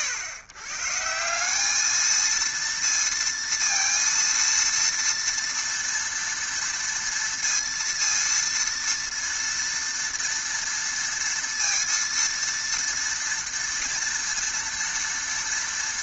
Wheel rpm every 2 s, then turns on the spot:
120, 230, 230, 230, 230, 230, 230, 230.
none